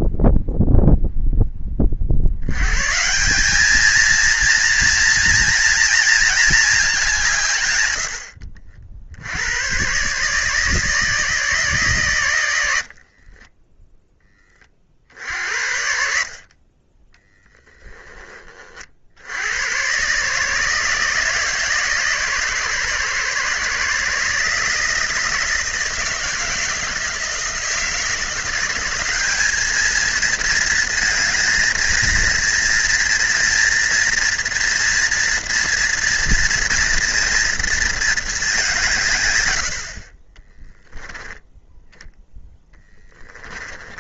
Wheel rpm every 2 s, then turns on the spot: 0, 110, 230, 220, 60, 150, 80, 30, 40, 30, 150, 140, 160, 160, 180, 220, 230, 240, 230, 180, 20, 0.
40-42